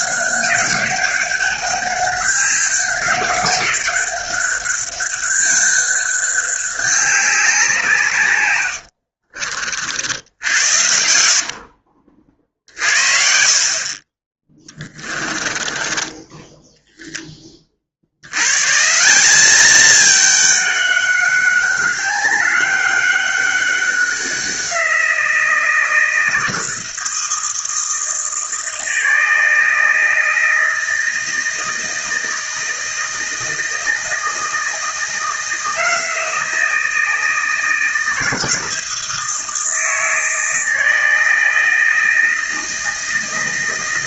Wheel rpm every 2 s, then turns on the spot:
200, 200, 200, 200, 80, 80, 50, 10, 10, 170, 200, 200, 180, 170, 160, 160, 160, 160, 160, 160, 160, 160.
8-12 14-16